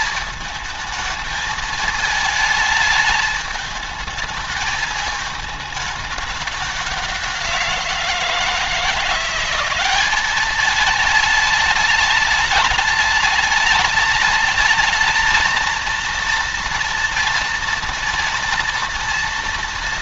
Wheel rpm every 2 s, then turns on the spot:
220, 220, 210, 190, 170, 210, 210, 220, 230, 230.
none